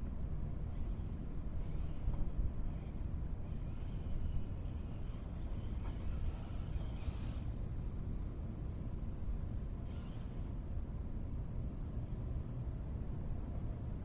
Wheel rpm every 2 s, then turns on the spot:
0, 0, 0, 0, 0, 0, 0.
none